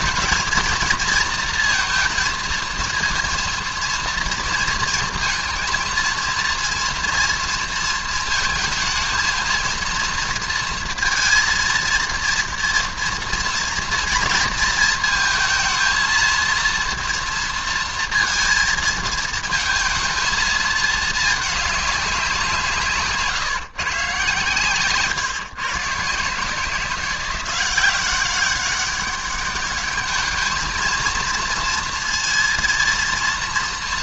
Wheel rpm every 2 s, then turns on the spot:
230, 230, 230, 230, 220, 230, 230, 220, 230, 230, 220, 170, 130, 160, 200, 220, 230.
none